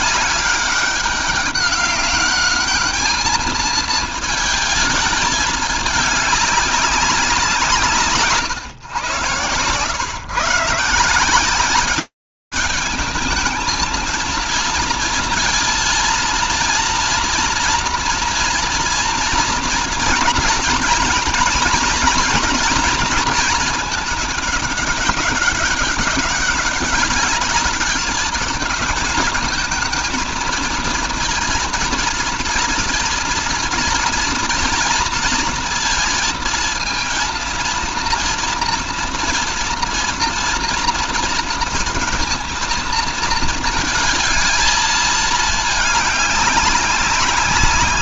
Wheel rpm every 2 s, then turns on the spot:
200, 210, 220, 200, 130, 150, 220, 230, 230, 240, 230, 220, 200, 210, 220, 230, 230, 230, 230, 230, 230, 230, 220, 190.
none